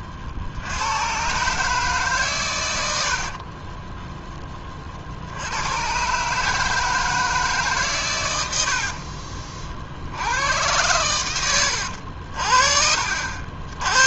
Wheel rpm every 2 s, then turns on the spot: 80, 110, 20, 150, 70, 100, 50.
none